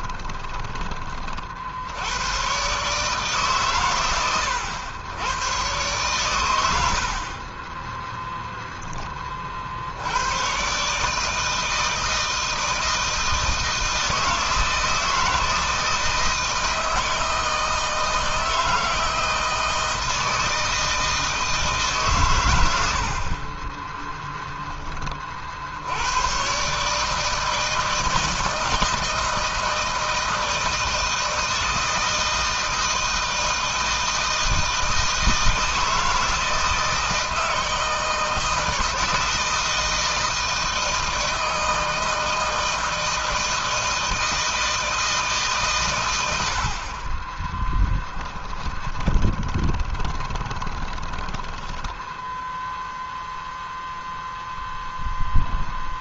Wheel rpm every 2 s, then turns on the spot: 40, 140, 110, 40, 30, 150, 160, 160, 160, 160, 160, 60, 40, 150, 160, 160, 160, 160, 160, 160, 160, 160, 160, 40, 20, 20, 0, 0.
46-52